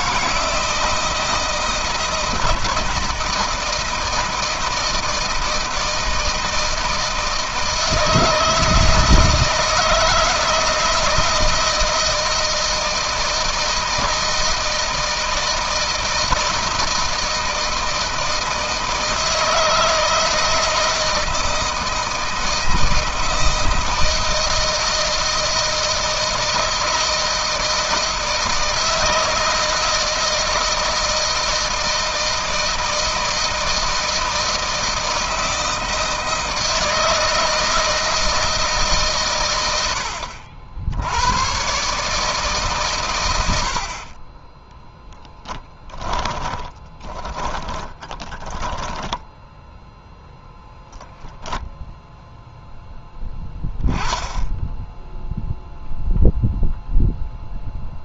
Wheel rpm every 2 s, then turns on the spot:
160, 170, 160, 160, 160, 160, 160, 160, 160, 160, 160, 160, 160, 160, 160, 160, 160, 160, 160, 160, 80, 150, 30, 20, 10, 0, 0, 10, 0.
44-50